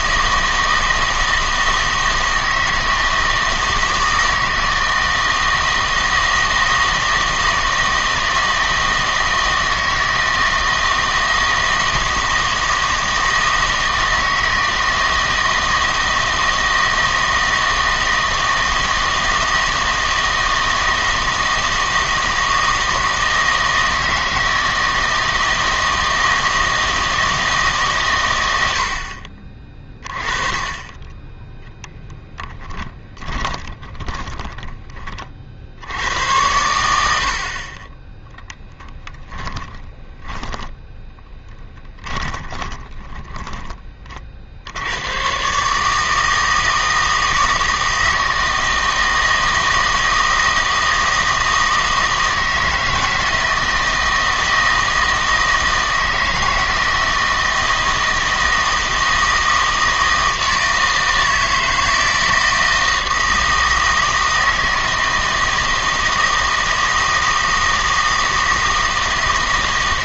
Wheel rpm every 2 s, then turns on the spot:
160, 160, 160, 160, 160, 160, 160, 160, 160, 160, 160, 160, 160, 160, 70, 20, 20, 30, 90, 10, 10, 30, 80, 160, 160, 160, 160, 160, 160, 160, 160, 160, 160, 160, 160.
32-36 38-44